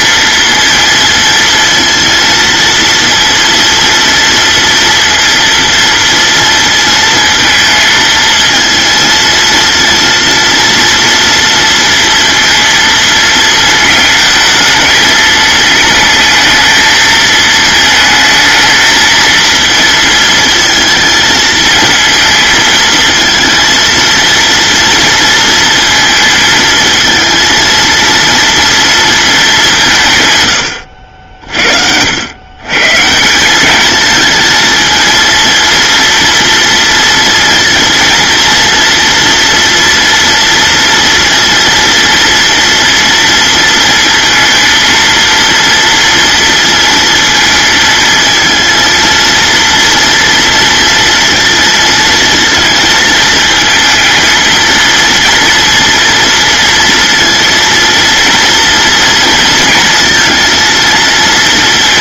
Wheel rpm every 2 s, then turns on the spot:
230, 230, 230, 230, 220, 230, 230, 220, 220, 220, 220, 220, 230, 230, 230, 100, 130, 230, 230, 230, 230, 240, 230, 230, 230, 230, 220, 230, 230, 240, 230.
30-32